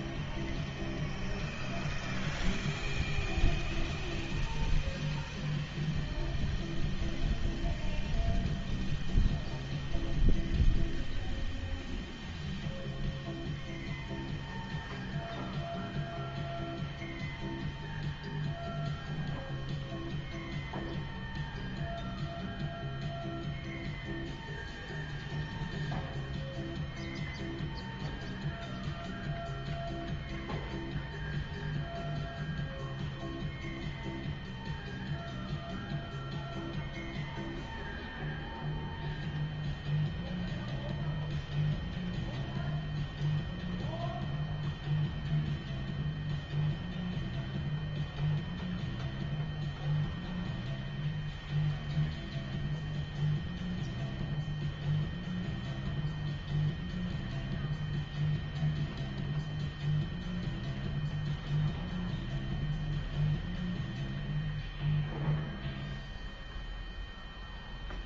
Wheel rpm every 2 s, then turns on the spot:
0, 0, 0, 0, 0, 0, 0, 0, 0, 0, 0, 0, 0, 0, 0, 0, 0, 0, 0, 0, 0, 0, 0, 0, 0, 0, 0, 0, 0, 0, 0, 0, 0, 0.
none